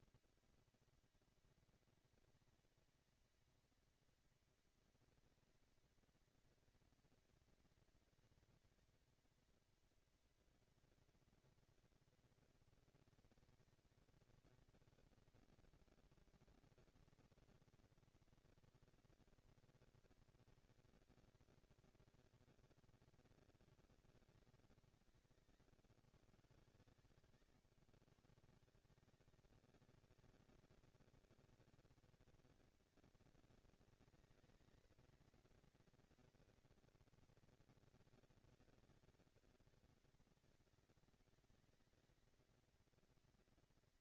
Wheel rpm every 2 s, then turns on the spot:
230, 230, 230, 230, 240, 230, 230, 220, 230, 230, 230, 220, 200, 140, 150, 220, 230, 220, 230, 230, 230, 230.
none